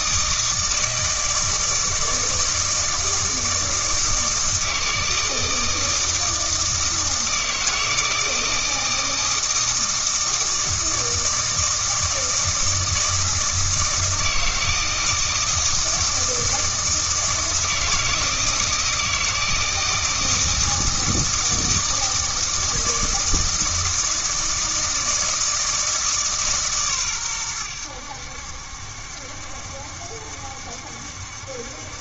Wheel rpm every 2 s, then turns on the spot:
160, 160, 160, 160, 160, 160, 160, 160, 160, 160, 160, 160, 160, 140, 70, 70.
none